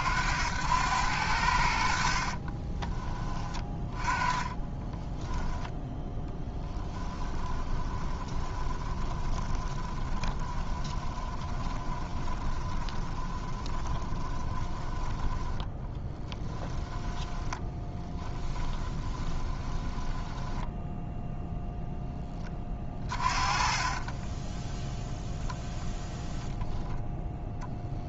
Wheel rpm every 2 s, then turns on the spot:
90, 30, 20, 20, 20, 20, 20, 10, 10, 10, 10, 20, 10, 0.
2-14 16-26